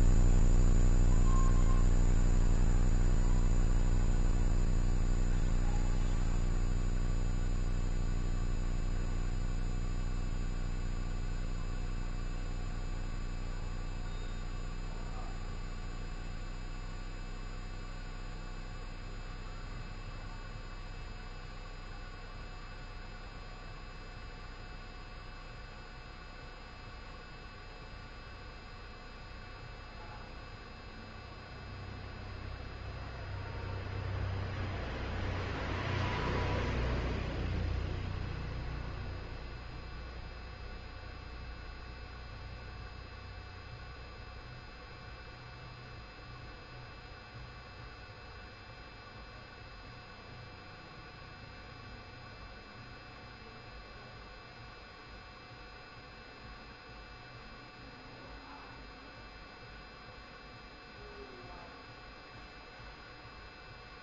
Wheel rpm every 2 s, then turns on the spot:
0, 0, 0, 0, 0, 0, 0, 0, 0, 0, 0, 0, 0, 0, 0, 0, 0, 0, 0, 0, 0, 0, 0, 0, 0, 0, 0, 0, 0, 0, 0, 0.
none